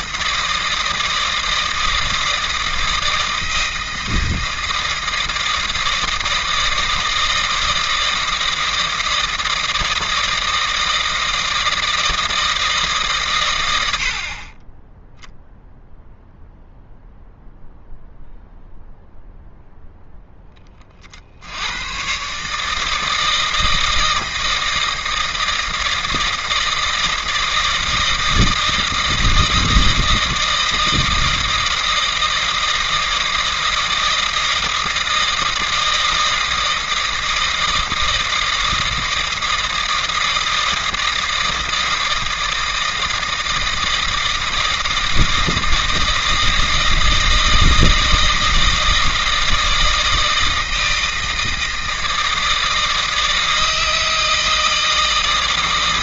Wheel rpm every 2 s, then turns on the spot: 160, 160, 160, 160, 160, 160, 160, 10, 0, 0, 30, 160, 160, 160, 160, 160, 160, 160, 160, 160, 160, 160, 160, 160, 160, 160, 160, 160.
none